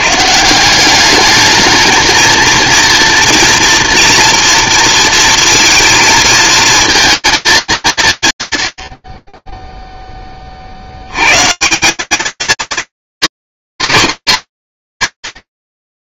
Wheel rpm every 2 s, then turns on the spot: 190, 230, 230, 230, 80, 30, 220, 140.
none